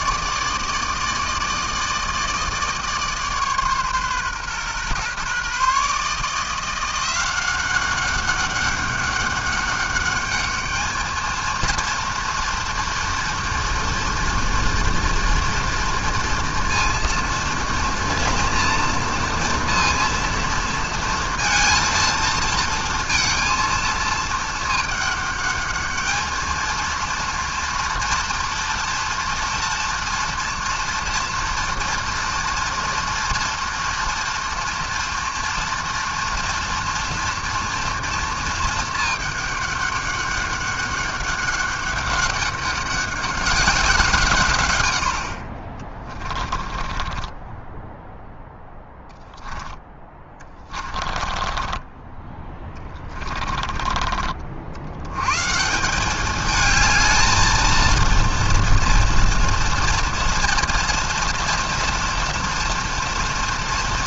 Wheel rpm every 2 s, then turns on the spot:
150, 160, 130, 170, 200, 210, 230, 230, 230, 230, 230, 230, 220, 220, 240, 240, 230, 230, 230, 220, 200, 200, 120, 30, 0, 20, 20, 50, 210, 240, 230, 230.
46-48 50-54